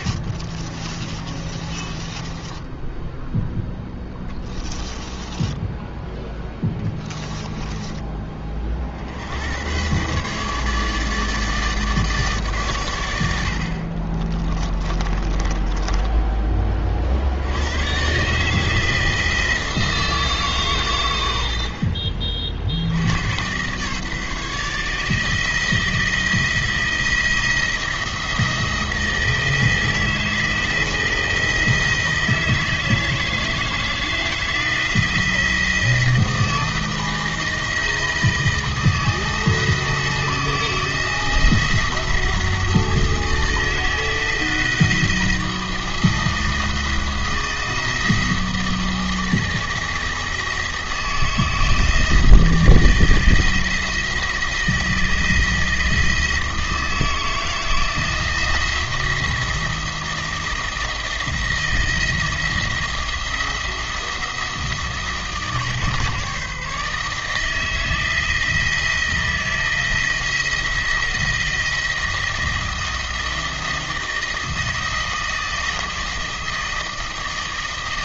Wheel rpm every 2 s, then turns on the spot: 30, 10, 10, 10, 50, 150, 120, 20, 30, 160, 130, 60, 150, 170, 160, 160, 160, 170, 160, 160, 170, 160, 160, 170, 160, 160, 160, 160, 160, 170, 160, 170, 160, 150, 170, 170, 160, 160, 160.
0-4 6-8 14-16